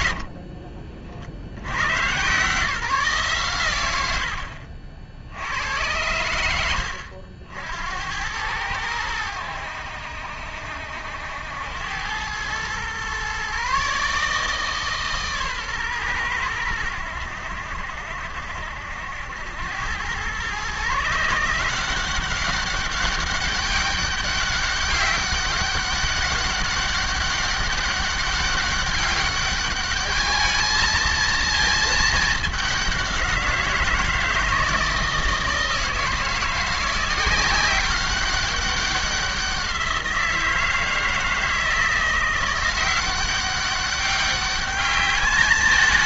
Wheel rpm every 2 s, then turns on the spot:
60, 150, 70, 80, 100, 70, 110, 150, 100, 70, 130, 190, 200, 200, 200, 220, 200, 160, 170, 190, 170, 180, 200.
0-2